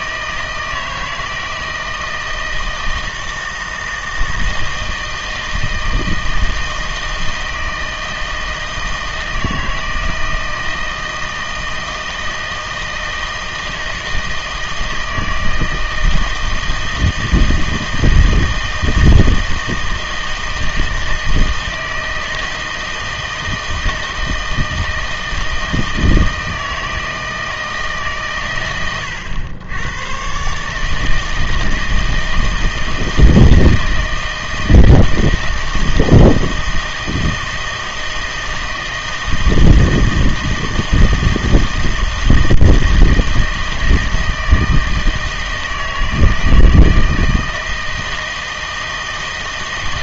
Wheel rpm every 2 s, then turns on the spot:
160, 160, 160, 160, 160, 160, 160, 160, 160, 160, 160, 160, 160, 160, 110, 140, 160, 160, 160, 160, 160, 160, 160, 160, 160.
none